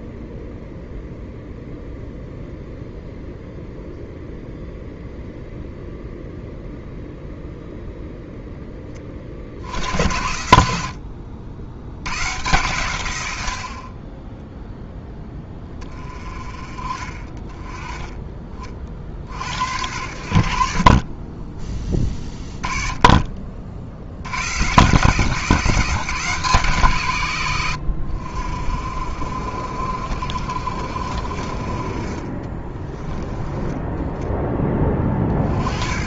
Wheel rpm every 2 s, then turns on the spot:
0, 0, 0, 0, 10, 80, 110, 10, 30, 30, 50, 20, 120, 160, 60, 50, 20, 10.
32-34